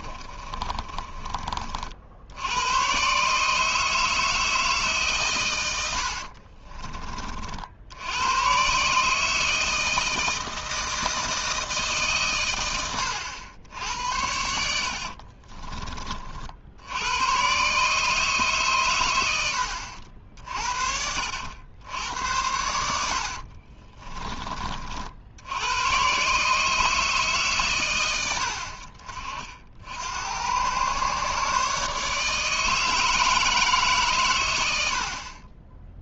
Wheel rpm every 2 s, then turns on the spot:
30, 100, 160, 40, 130, 160, 100, 70, 70, 140, 50, 90, 40, 150, 70, 110, 160, 90.
0-2 6-8 12-16 22-24